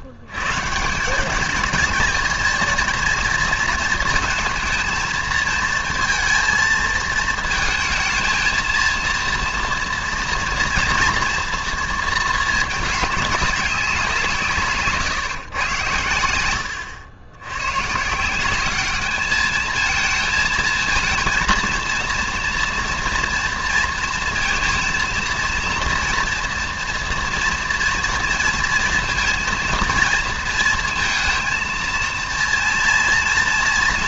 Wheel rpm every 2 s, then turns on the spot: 130, 230, 220, 230, 230, 230, 210, 160, 100, 190, 220, 230, 230, 240, 230, 230, 230.
none